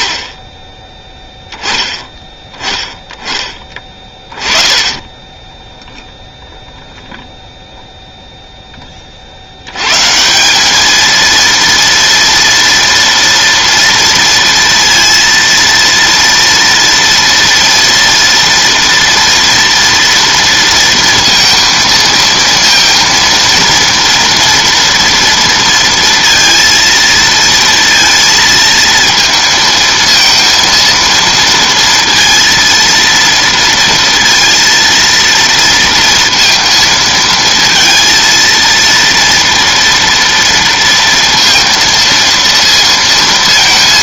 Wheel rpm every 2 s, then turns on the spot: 10, 10, 20, 0, 10, 200, 230, 230, 230, 230, 230, 230, 230, 230, 230, 230, 230, 230, 220, 230, 230, 230.
none